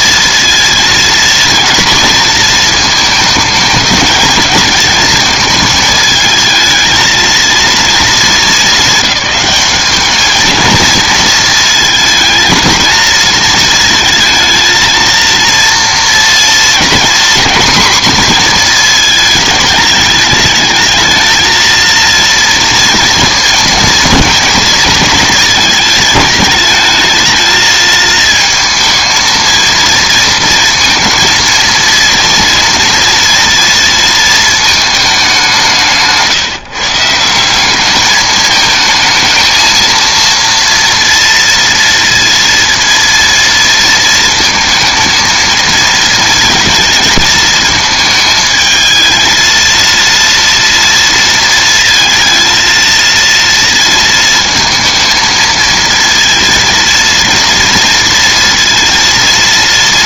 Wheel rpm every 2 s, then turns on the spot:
230, 230, 220, 220, 200, 220, 230, 230, 230, 230, 210, 230, 230, 210, 230, 220, 230, 220, 150, 220, 230, 230, 230, 220, 220, 230, 230, 230, 230, 230.
none